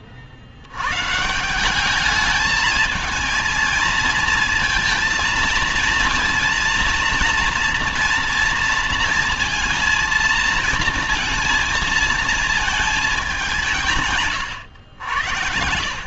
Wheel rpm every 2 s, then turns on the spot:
60, 220, 230, 230, 230, 230, 220, 120.
none